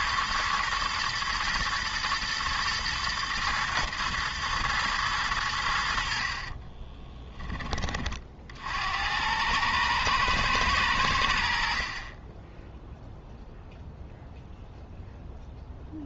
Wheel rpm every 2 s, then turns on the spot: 120, 110, 110, 30, 70, 100, 10, 0.
6-8